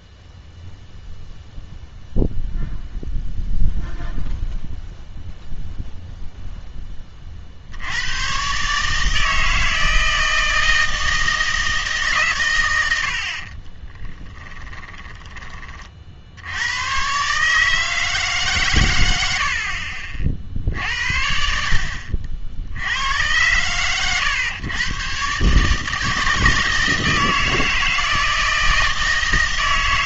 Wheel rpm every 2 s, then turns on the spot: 0, 0, 0, 0, 130, 160, 110, 20, 90, 140, 60, 70, 120, 160, 160.
14-16